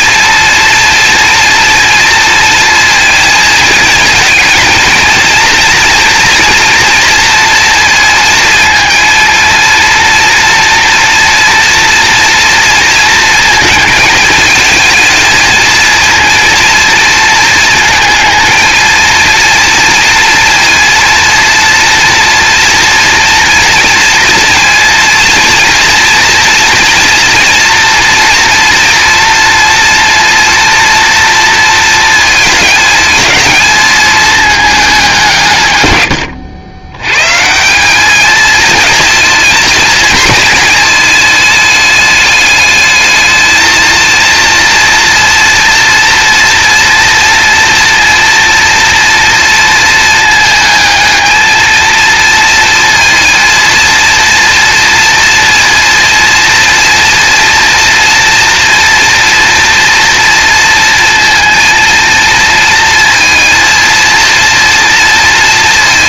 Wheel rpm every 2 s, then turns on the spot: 230, 230, 230, 240, 230, 230, 230, 220, 230, 220, 230, 230, 230, 230, 240, 230, 220, 210, 80, 220, 220, 210, 230, 240, 230, 220, 230, 230, 230, 230, 230, 230, 230.
none